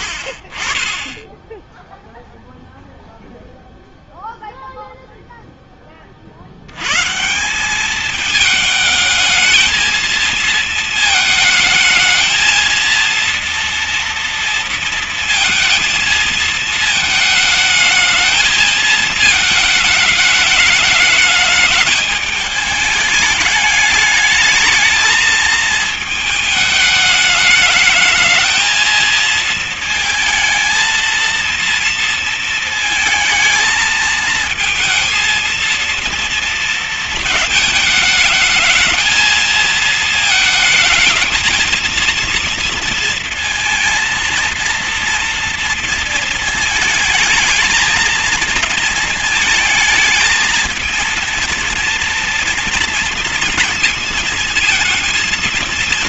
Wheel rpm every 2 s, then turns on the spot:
30, 0, 0, 90, 220, 220, 220, 230, 220, 220, 220, 210, 220, 220, 220, 230, 230, 220, 230, 220, 220, 230, 240, 220, 230, 220, 230, 220.
none